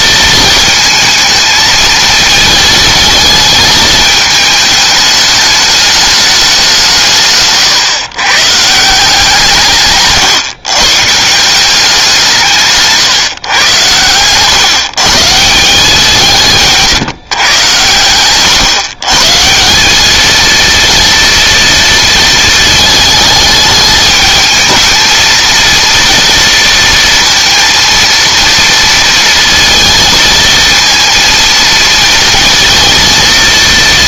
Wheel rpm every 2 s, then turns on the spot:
220, 220, 210, 170, 160, 140, 140, 140, 150, 130, 230, 220, 220, 230, 230, 230, 230.
none